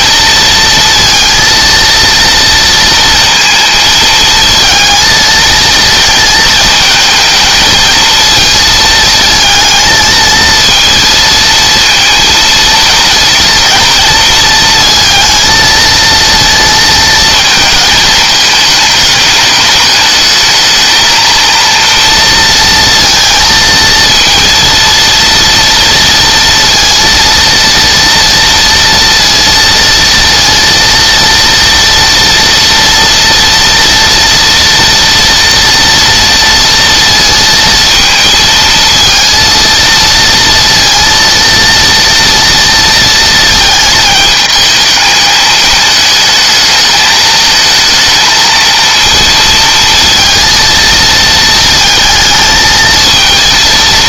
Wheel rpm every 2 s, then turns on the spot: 230, 230, 230, 220, 230, 230, 230, 230, 230, 220, 230, 230, 230, 230, 230, 230, 230, 230, 230, 230, 230, 230, 220, 220, 230, 230, 220.
none